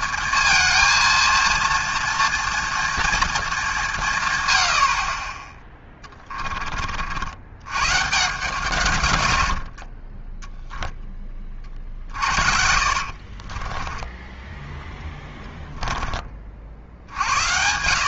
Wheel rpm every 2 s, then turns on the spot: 230, 230, 80, 30, 120, 0, 60, 10, 50.
12-16